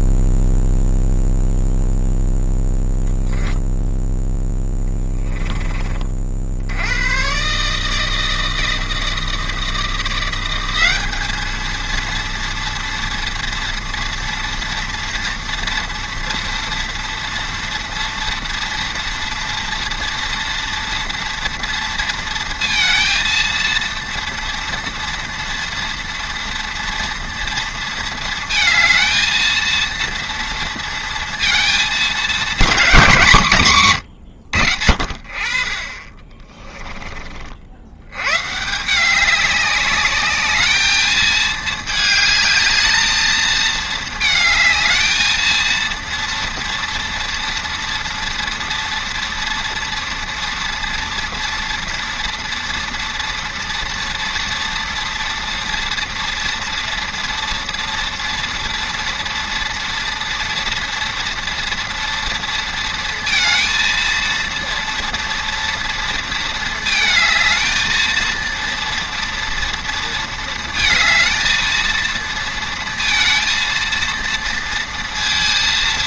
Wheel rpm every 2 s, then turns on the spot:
0, 10, 10, 60, 160, 180, 230, 230, 240, 230, 230, 230, 230, 230, 220, 230, 220, 110, 20, 120, 210, 210, 220, 230, 230, 230, 230, 230, 230, 230, 230, 230, 230, 230, 230, 230, 230, 230.
4-6 36-38